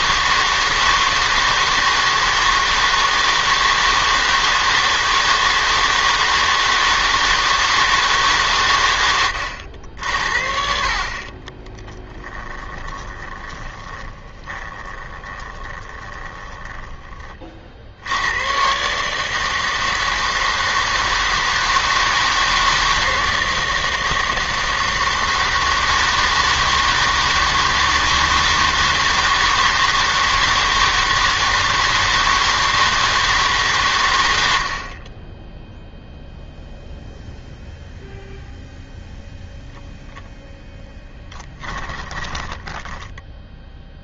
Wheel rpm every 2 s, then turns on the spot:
160, 160, 160, 160, 130, 50, 20, 20, 10, 110, 160, 160, 160, 160, 160, 160, 160, 80, 0, 0, 0, 10.
12-18 42-44